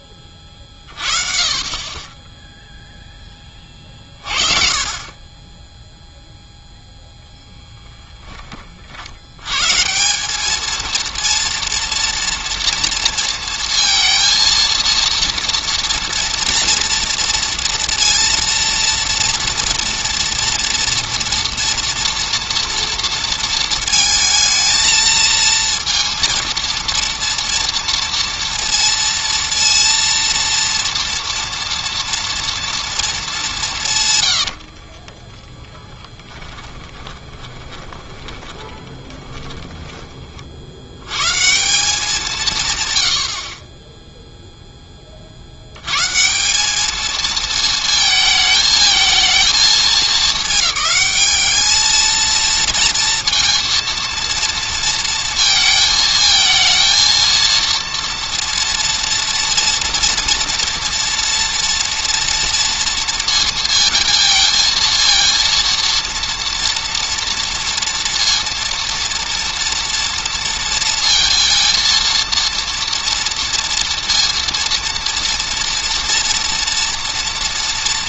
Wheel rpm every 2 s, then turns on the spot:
30, 0, 40, 0, 30, 210, 230, 230, 230, 230, 230, 240, 220, 230, 230, 230, 230, 60, 10, 20, 60, 130, 10, 200, 220, 210, 230, 230, 230, 230, 230, 230, 230, 230, 230, 230, 230, 230, 230.
34-40